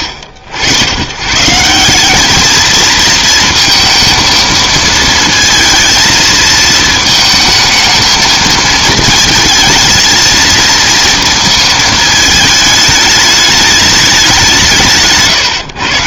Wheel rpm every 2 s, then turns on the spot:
100, 220, 230, 220, 220, 230, 210, 170.
none